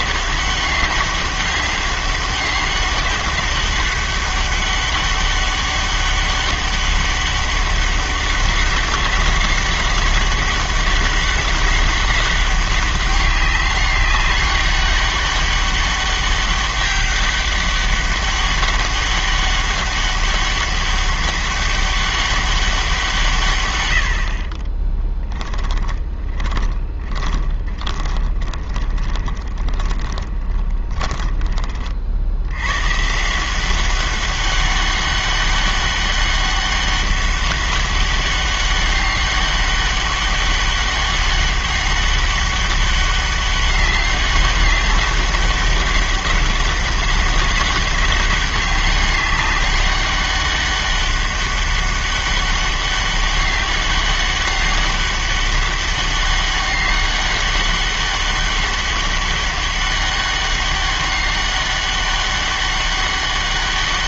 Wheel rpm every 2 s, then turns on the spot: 190, 200, 200, 200, 190, 200, 200, 200, 200, 200, 200, 190, 30, 20, 20, 10, 100, 200, 200, 200, 200, 200, 200, 200, 200, 200, 200, 200, 200, 200, 200, 200.
24-32